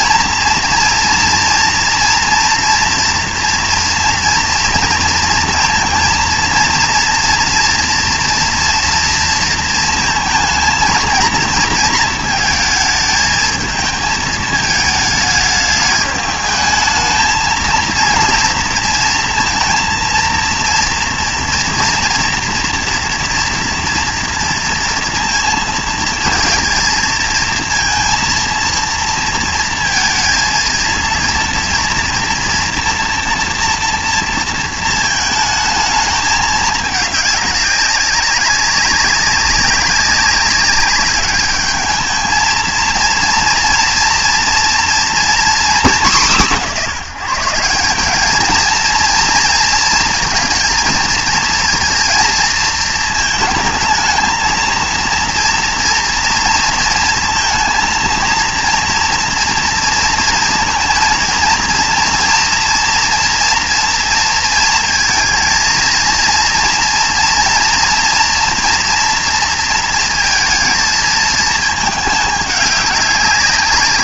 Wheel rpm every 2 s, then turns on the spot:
230, 230, 230, 230, 230, 230, 220, 220, 220, 230, 230, 240, 230, 230, 230, 230, 230, 220, 210, 190, 200, 220, 230, 180, 220, 220, 230, 220, 230, 230, 230, 230, 230, 230, 230, 220, 200.
none